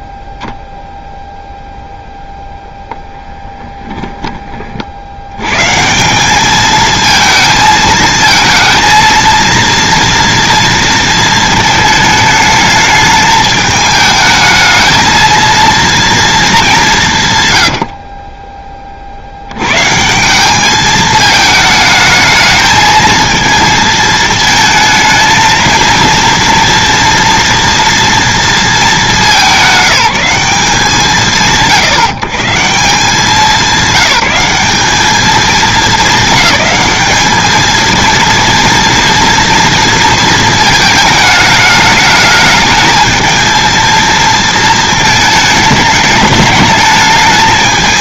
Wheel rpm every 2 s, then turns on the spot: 0, 0, 40, 220, 230, 230, 220, 220, 200, 20, 210, 220, 220, 230, 220, 150, 190, 190, 220, 230, 220, 220, 230, 210.
none